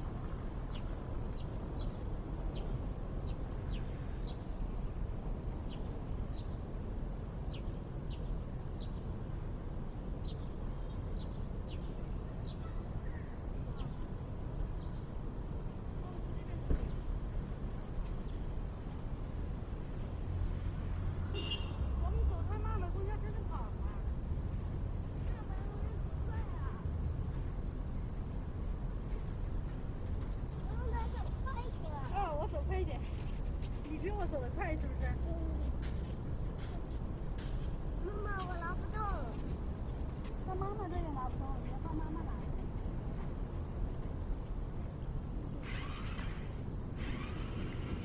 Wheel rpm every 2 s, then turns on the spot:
0, 0, 0, 0, 0, 0, 0, 0, 0, 0, 0, 0, 0, 0, 0, 0, 0, 0, 0, 0, 0, 0, 0, 0.
none